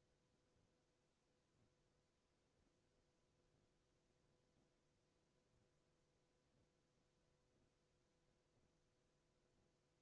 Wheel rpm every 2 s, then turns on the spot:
0, 0, 0, 0, 0.
none